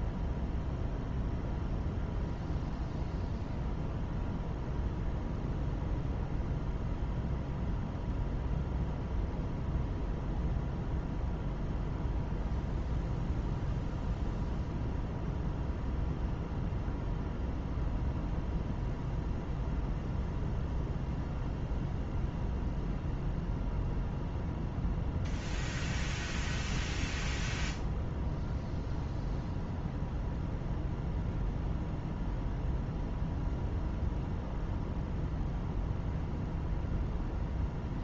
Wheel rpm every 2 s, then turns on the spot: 0, 0, 0, 0, 0, 0, 0, 0, 0, 0, 0, 0, 0, 0, 0, 0, 0, 0, 0.
none